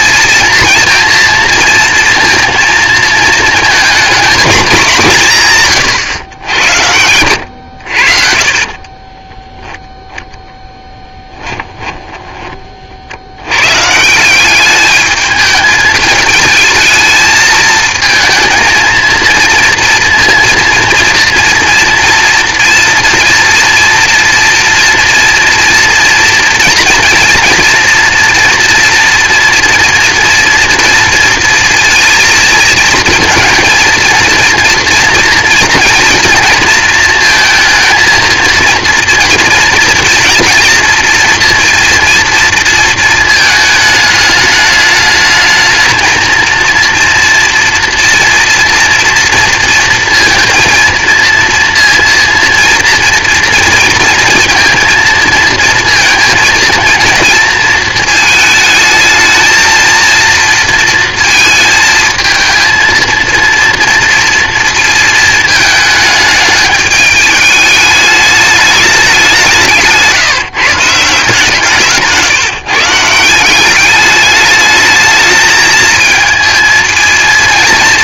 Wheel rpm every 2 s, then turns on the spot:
230, 230, 200, 90, 40, 10, 40, 200, 220, 230, 230, 230, 230, 230, 240, 230, 230, 240, 230, 230, 230, 230, 210, 230, 230, 230, 230, 230, 230, 220, 230, 220, 230, 210, 210, 160, 150, 210, 220.
8-10